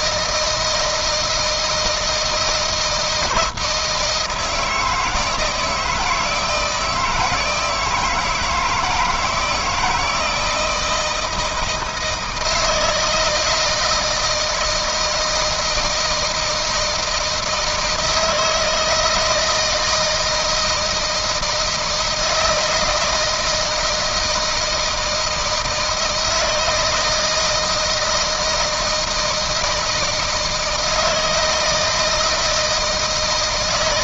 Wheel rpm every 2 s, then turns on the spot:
160, 170, 160, 160, 160, 160, 160, 160, 170, 160, 160, 160, 160, 160, 160, 160, 160.
none